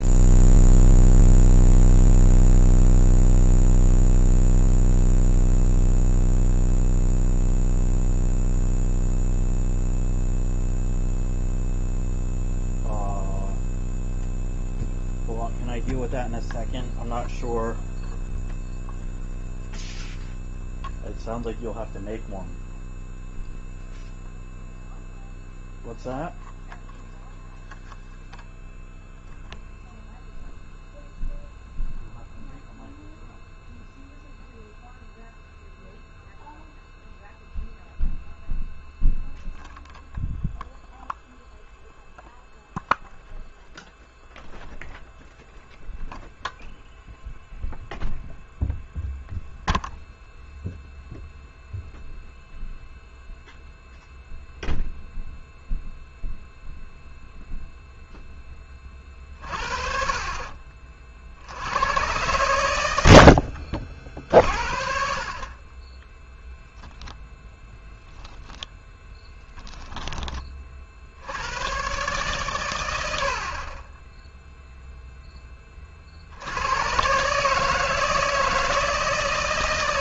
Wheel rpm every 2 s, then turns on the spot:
0, 0, 0, 0, 0, 0, 0, 0, 0, 0, 0, 0, 0, 0, 0, 0, 0, 0, 0, 0, 0, 0, 0, 0, 0, 0, 0, 0, 0, 10, 40, 100, 50, 0, 0, 20, 120, 0, 90, 160.
60-62